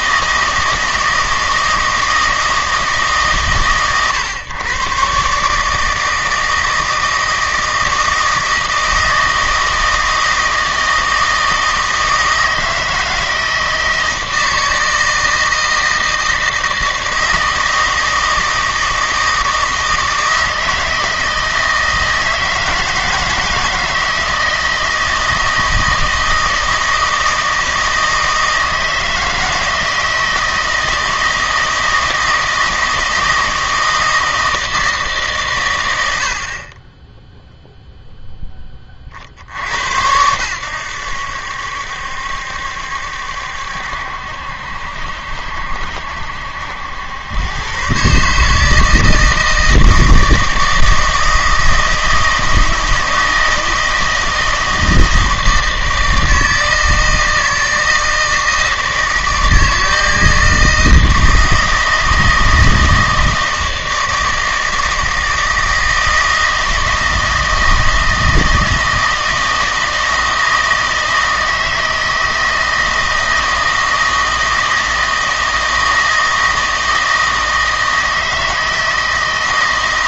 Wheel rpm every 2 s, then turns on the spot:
160, 160, 130, 160, 160, 160, 160, 160, 160, 160, 160, 160, 160, 160, 160, 160, 160, 160, 20, 20, 100, 70, 70, 80, 160, 160, 160, 160, 160, 160, 160, 160, 160, 160, 160, 160, 160, 160, 160, 160.
none